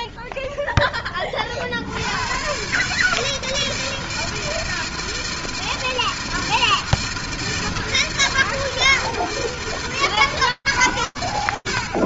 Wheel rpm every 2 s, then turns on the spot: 80, 160, 160, 160, 150, 120.
none